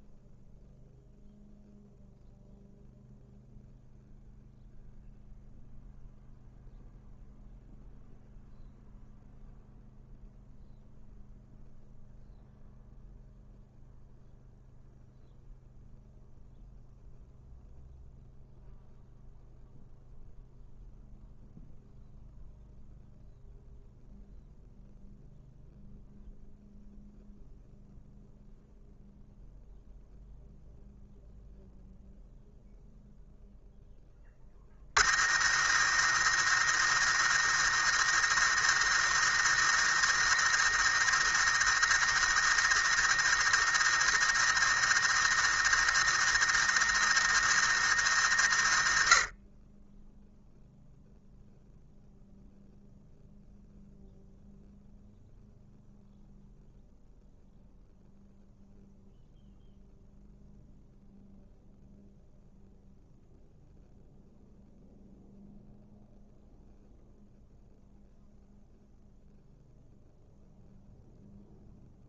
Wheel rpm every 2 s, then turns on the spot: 0, 0, 0, 0, 0, 0, 0, 0, 0, 0, 0, 0, 0, 0, 0, 0, 0, 50, 110, 110, 110, 110, 110, 110, 80, 0, 0, 0, 0, 0, 0, 0, 0, 0, 0, 0.
none